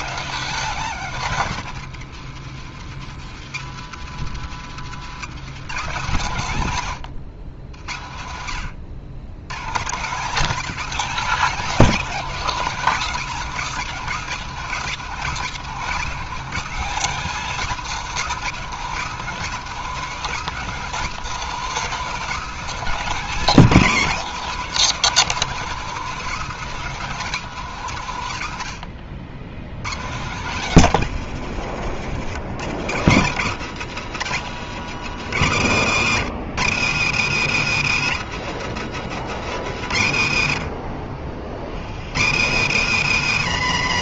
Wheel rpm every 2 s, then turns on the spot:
190, 150, 180, 110, 110, 250, 240, 220, 250, 220, 230, 250, 240, 220, 80, 150, 140, 150, 140, 170, 40, 140.
4-6